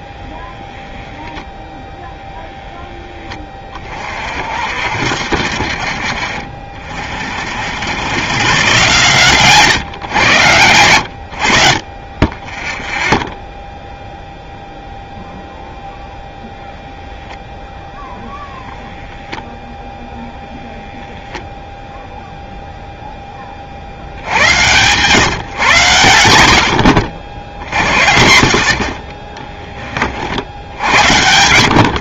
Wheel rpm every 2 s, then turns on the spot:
10, 0, 60, 40, 130, 110, 10, 0, 0, 0, 0, 0, 100, 70, 60, 80.
none